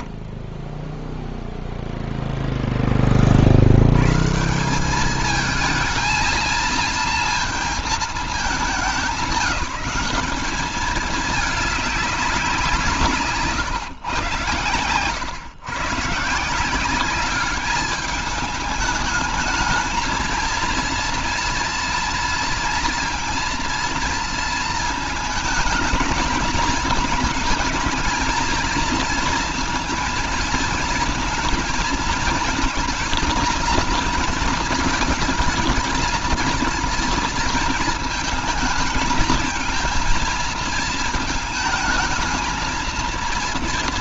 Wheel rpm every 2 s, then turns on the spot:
0, 20, 190, 220, 210, 200, 150, 110, 190, 220, 230, 230, 230, 220, 230, 230, 230, 220, 230, 220, 220, 230.
none